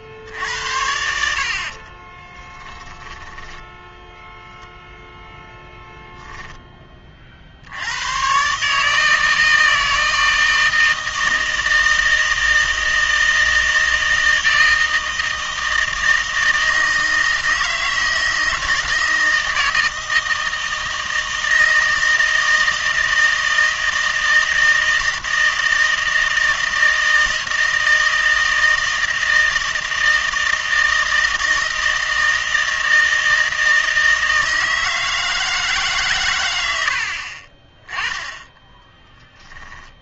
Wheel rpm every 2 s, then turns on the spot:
80, 10, 0, 10, 150, 160, 160, 160, 160, 160, 160, 160, 160, 160, 160, 160, 160, 160, 90, 10.
2-4